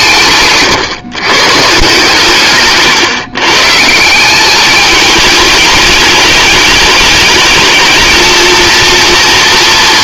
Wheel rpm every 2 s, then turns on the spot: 140, 130, 210, 210, 230.
none